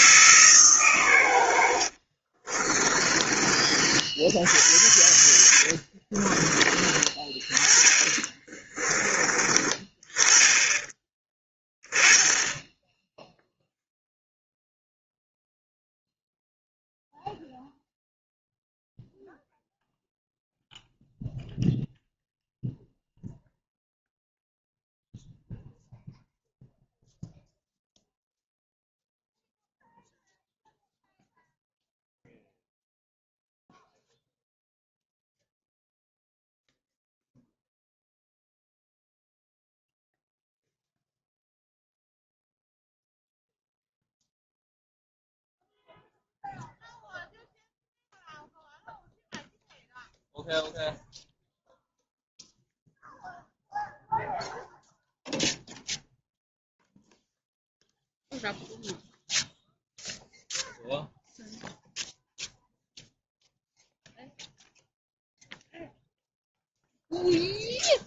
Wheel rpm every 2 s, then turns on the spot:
130, 30, 80, 30, 20, 20, 10, 0, 0, 0, 0, 0, 0, 0, 0, 0, 0, 0, 0, 0, 0, 0, 0, 0, 0, 0, 0, 0, 0, 0, 0, 0, 0, 0.
2-12